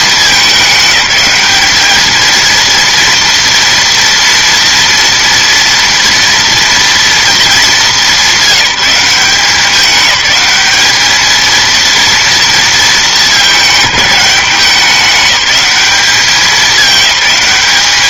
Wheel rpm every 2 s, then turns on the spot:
210, 230, 230, 240, 200, 210, 220, 200, 210.
none